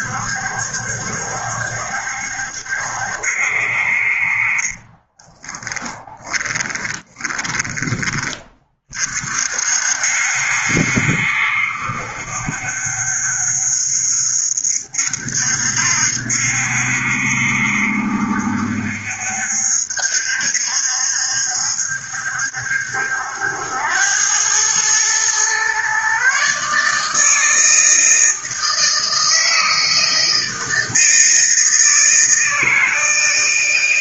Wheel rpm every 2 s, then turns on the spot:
70, 70, 20, 10, 40, 70, 60, 70, 70, 70, 70, 70, 120, 150, 160, 160, 160.
4-8